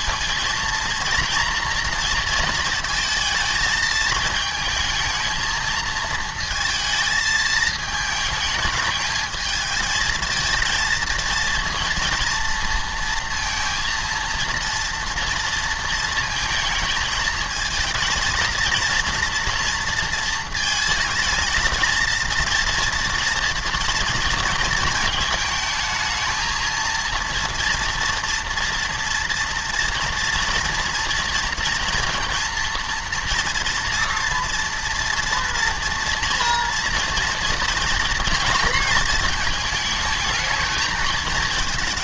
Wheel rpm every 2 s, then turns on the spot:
230, 230, 220, 230, 220, 230, 230, 230, 220, 230, 220, 230, 220, 230, 240, 230, 230, 230, 230, 220, 220.
none